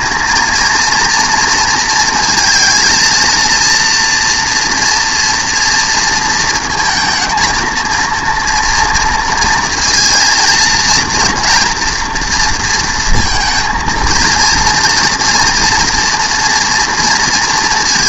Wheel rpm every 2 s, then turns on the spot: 230, 230, 230, 220, 230, 230, 230, 230, 240.
none